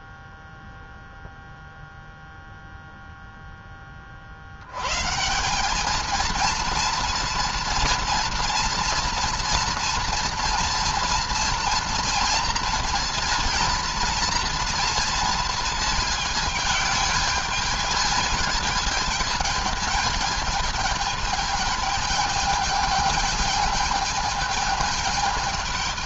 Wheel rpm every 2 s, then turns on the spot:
0, 0, 100, 230, 230, 230, 230, 230, 220, 220, 220, 220, 220.
none